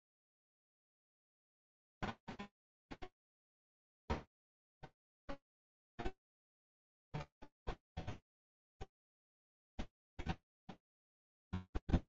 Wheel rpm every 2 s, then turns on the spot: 0, 10, 10, 10, 0, 10.
2-6 10-12